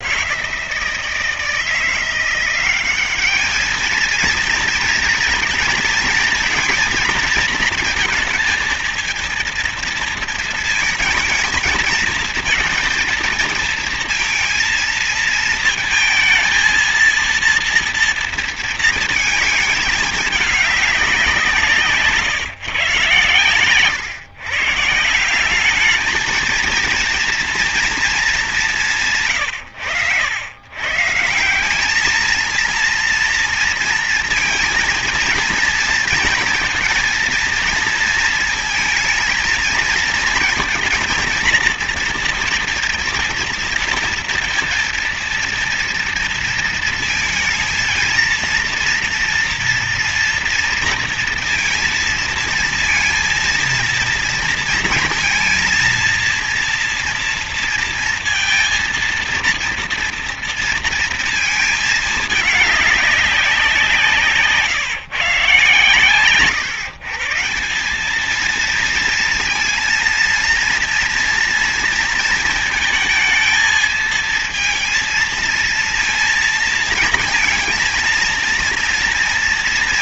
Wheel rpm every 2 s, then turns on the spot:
160, 190, 220, 230, 230, 230, 230, 230, 220, 230, 200, 130, 140, 230, 180, 120, 230, 230, 230, 220, 230, 230, 230, 230, 230, 230, 230, 230, 230, 230, 230, 210, 150, 140, 220, 230, 230, 230, 230, 230.
none